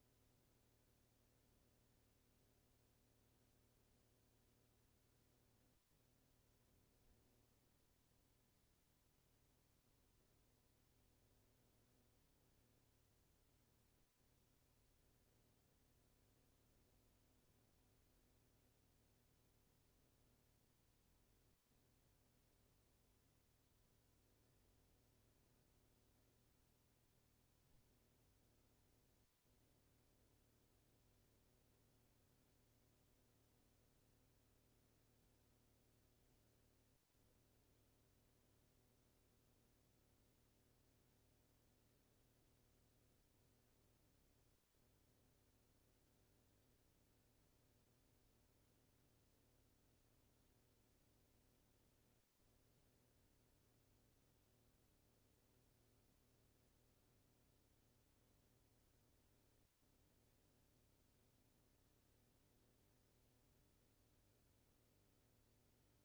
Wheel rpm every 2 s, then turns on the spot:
0, 0, 0, 0, 0, 0, 0, 0, 0, 0, 0, 0, 0, 0, 0, 0, 0, 0, 0, 0, 0, 0, 0, 0, 0, 0, 0, 0, 0, 0, 0, 0, 0.
none